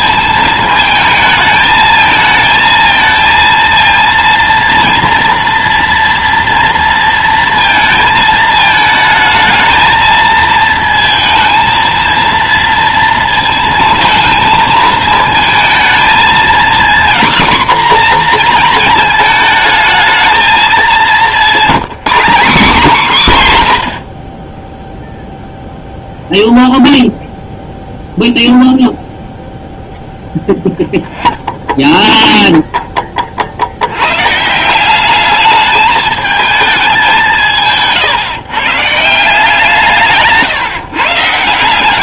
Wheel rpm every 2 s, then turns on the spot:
220, 220, 230, 230, 220, 220, 230, 220, 240, 230, 210, 230, 10, 0, 0, 0, 10, 170, 210, 140, 150.
none